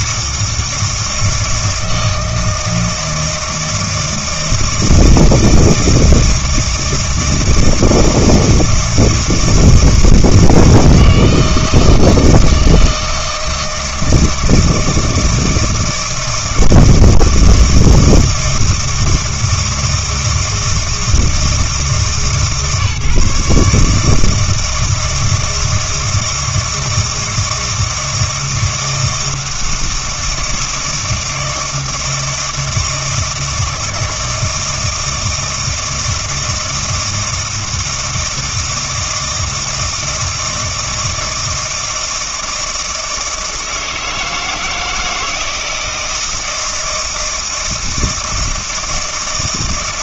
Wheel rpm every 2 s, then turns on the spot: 160, 170, 160, 160, 160, 160, 160, 160, 160, 160, 160, 150, 160, 160, 160, 160, 160, 160, 160, 160, 160, 170, 160, 160, 160.
none